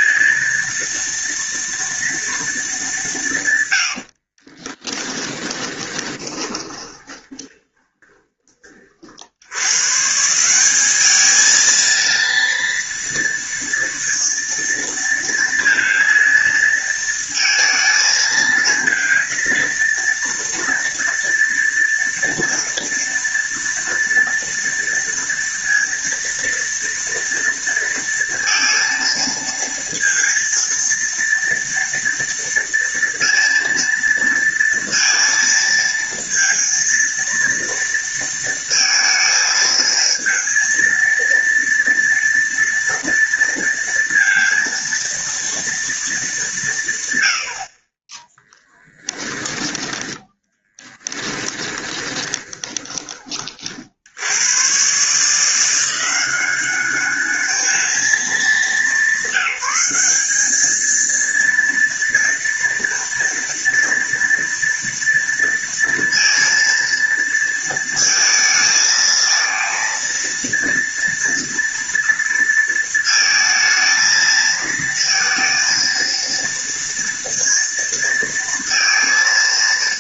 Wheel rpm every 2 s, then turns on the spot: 230, 200, 20, 20, 30, 180, 230, 230, 230, 220, 230, 230, 230, 230, 230, 230, 230, 230, 230, 230, 230, 230, 230, 160, 10, 10, 20, 110, 190, 210, 220, 230, 230, 230, 220, 230, 230, 230, 230, 230.
4-8 48-54